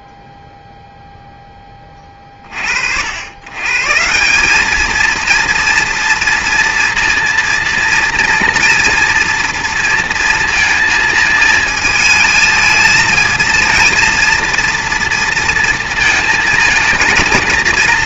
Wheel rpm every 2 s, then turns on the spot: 0, 40, 210, 230, 230, 230, 220, 230, 230.
none